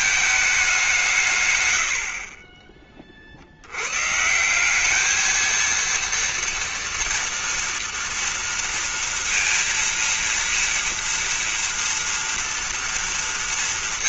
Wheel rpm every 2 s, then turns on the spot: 170, 50, 210, 230, 230, 230, 230.
none